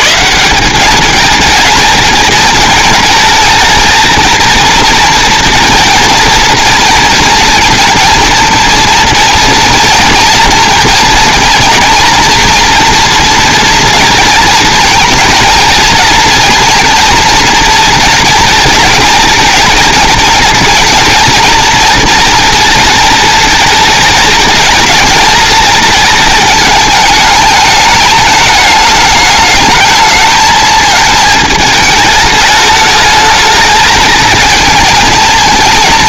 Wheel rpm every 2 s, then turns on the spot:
190, 230, 230, 230, 230, 220, 230, 230, 230, 220, 230, 230, 220, 210, 210, 220, 210, 220.
none